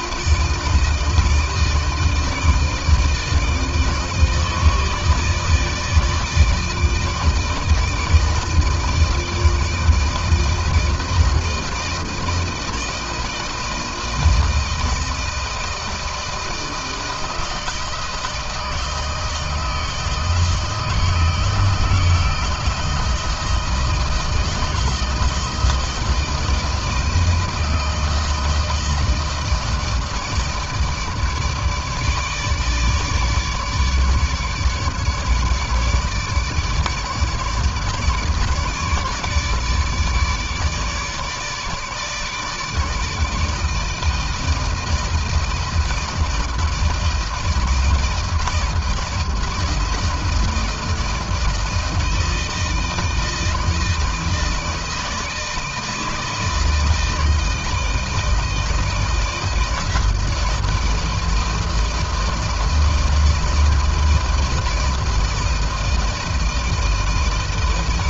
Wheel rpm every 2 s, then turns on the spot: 160, 160, 150, 160, 160, 160, 160, 160, 160, 160, 160, 160, 160, 160, 160, 160, 150, 150, 150, 150, 150, 160, 160, 160, 160, 160, 160, 160, 160, 160, 160, 160, 160, 160.
none